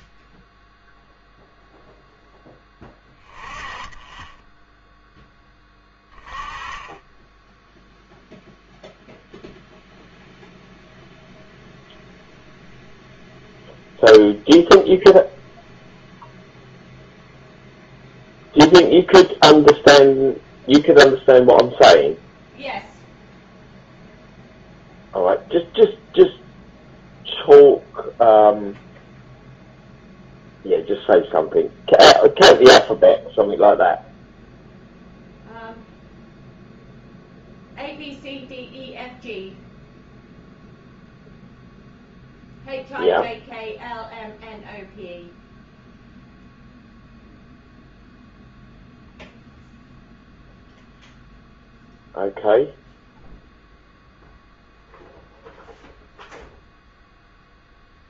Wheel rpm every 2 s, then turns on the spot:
0, 10, 10, 20, 0, 0, 0, 0, 0, 0, 0, 0, 0, 0, 0, 0, 0, 0, 0, 0, 0, 0, 0, 0, 0, 0, 0, 0, 0.
none